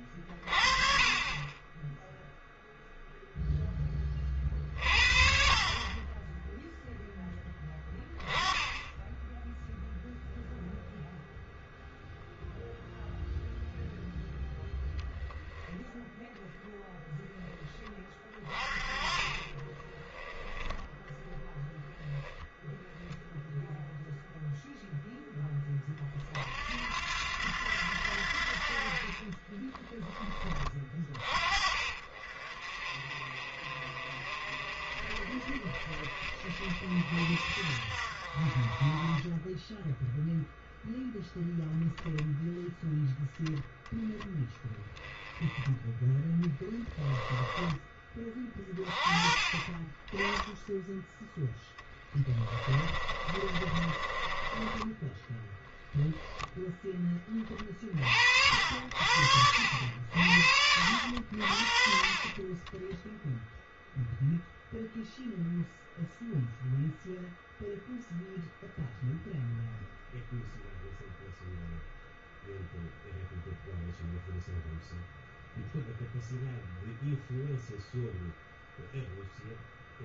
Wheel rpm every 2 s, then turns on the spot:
30, 0, 50, 0, 20, 0, 0, 0, 0, 30, 0, 0, 0, 70, 40, 30, 40, 50, 50, 20, 0, 10, 10, 10, 20, 10, 30, 10, 10, 60, 70, 10, 0, 0, 0, 0, 0, 0, 0, 0.
46-48 52-54 62-64